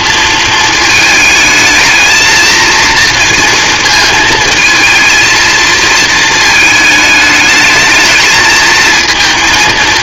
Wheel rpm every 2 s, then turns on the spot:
230, 230, 220, 220, 220.
none